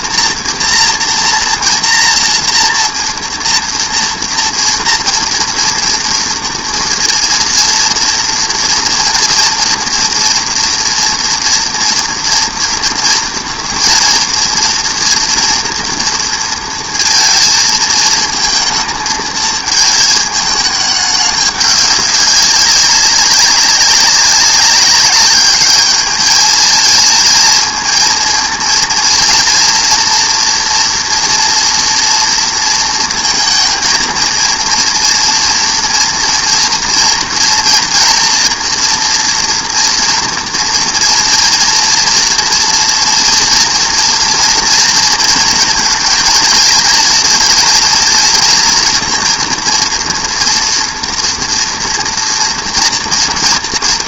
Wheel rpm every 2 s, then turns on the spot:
230, 230, 230, 230, 230, 230, 230, 230, 230, 220, 210, 200, 200, 220, 230, 240, 230, 230, 230, 230, 230, 230, 230, 220, 230, 240, 230.
none